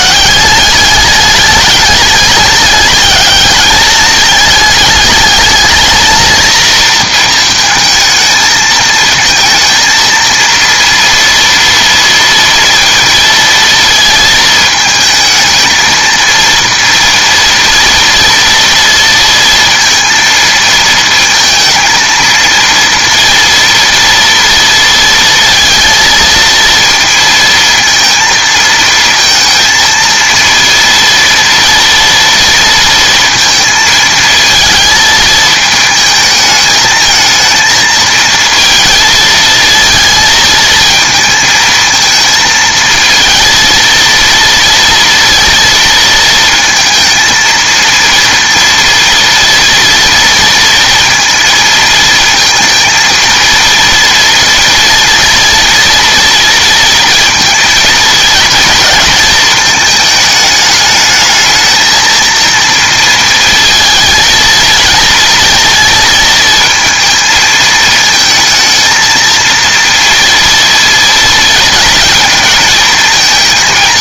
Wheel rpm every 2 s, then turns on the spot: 200, 210, 210, 230, 220, 230, 230, 220, 230, 230, 230, 230, 230, 230, 230, 230, 230, 220, 220, 220, 220, 220, 230, 230, 230, 230, 230, 230, 230, 230, 210, 230, 230, 230, 220, 230, 220.
none